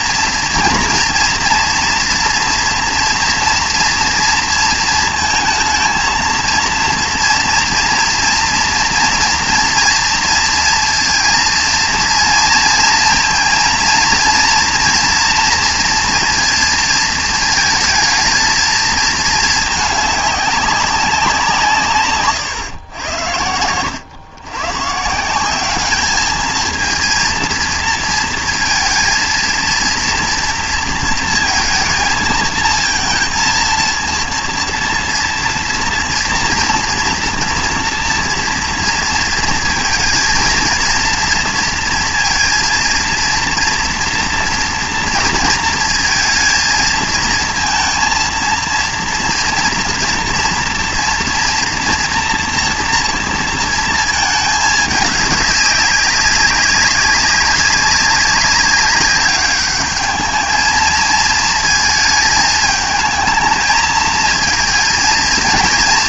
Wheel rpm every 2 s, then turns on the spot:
230, 230, 230, 230, 230, 230, 230, 230, 230, 220, 200, 130, 120, 220, 230, 230, 220, 230, 230, 230, 230, 230, 230, 220, 230, 230, 230, 220, 200, 200, 220, 220, 230.
22-24